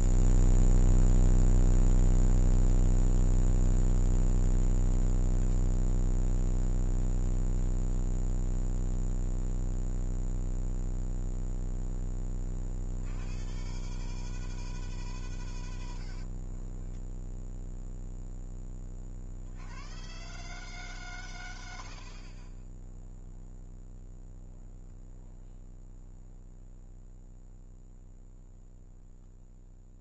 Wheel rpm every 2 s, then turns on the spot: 0, 0, 0, 10, 10, 0, 40, 160, 40, 10, 140, 20, 0, 0, 0.
6-8 16-18